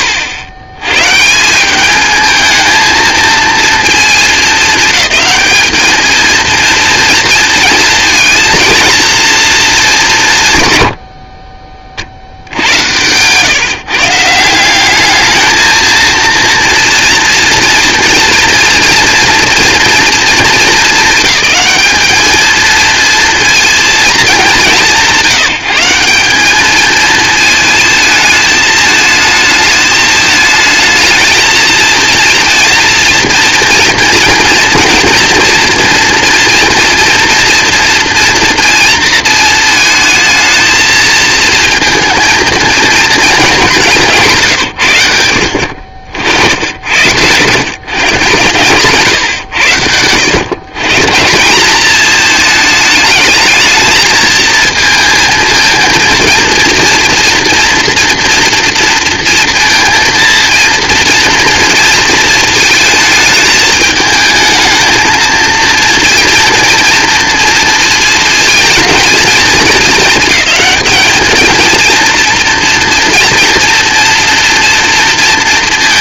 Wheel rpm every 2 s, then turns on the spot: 100, 230, 200, 230, 230, 80, 110, 190, 230, 230, 200, 230, 160, 220, 220, 220, 230, 230, 230, 230, 220, 230, 100, 90, 130, 140, 210, 230, 230, 230, 230, 220, 220, 230, 230, 220, 230, 230.
12-14